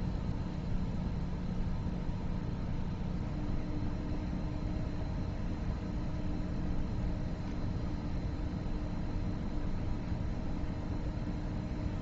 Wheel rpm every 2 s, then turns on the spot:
0, 0, 0, 0, 0, 0.
none